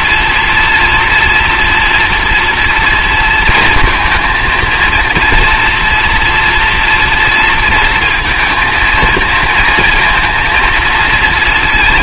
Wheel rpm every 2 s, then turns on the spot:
240, 230, 230, 230, 230, 230.
none